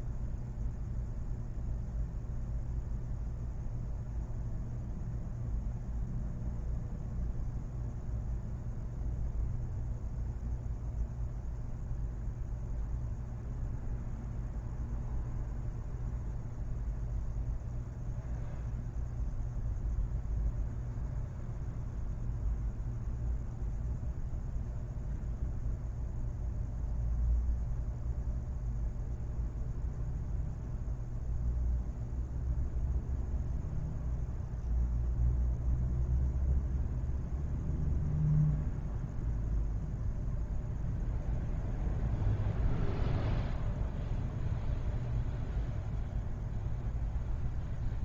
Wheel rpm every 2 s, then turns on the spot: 0, 0, 0, 0, 0, 0, 0, 0, 0, 0, 0, 0, 0, 0, 0, 0, 0, 0, 0, 0, 0, 0, 0, 0.
none